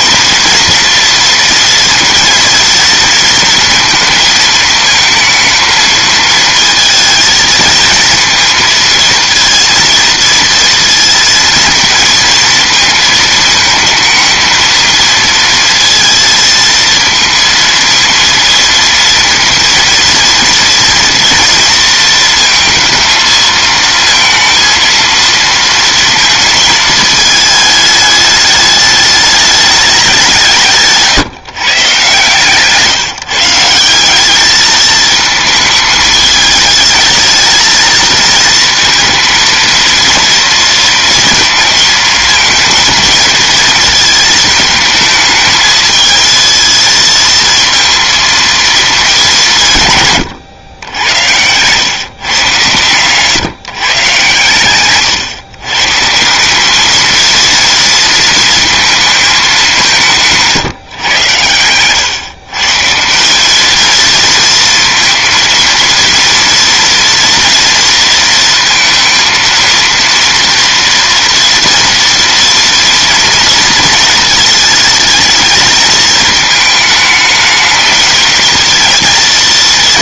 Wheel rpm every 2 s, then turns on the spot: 230, 230, 220, 230, 230, 230, 230, 220, 230, 230, 230, 220, 230, 230, 210, 170, 150, 210, 220, 230, 230, 220, 220, 220, 230, 110, 120, 130, 190, 230, 150, 140, 230, 230, 230, 230, 230, 220, 220, 220.
32-34